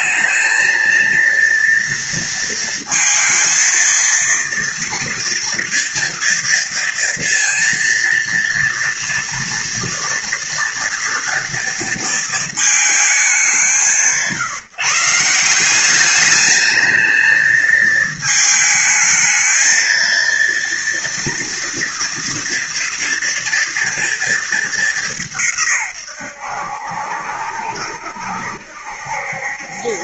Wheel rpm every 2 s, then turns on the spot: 230, 230, 230, 230, 230, 230, 200, 150, 220, 220, 230, 240, 200, 70, 70.
none